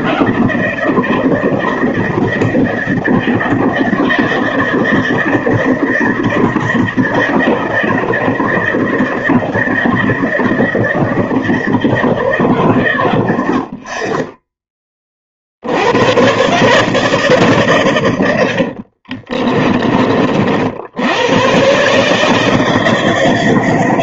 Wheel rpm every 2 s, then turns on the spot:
160, 160, 160, 160, 160, 160, 160, 30, 110, 110, 30, 140.
none